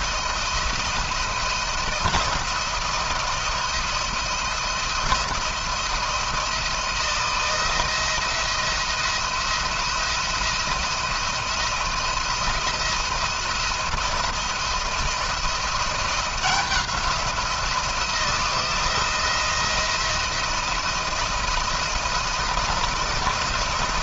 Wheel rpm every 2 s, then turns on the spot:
160, 170, 170, 160, 160, 170, 170, 170, 180, 170, 170, 170.
none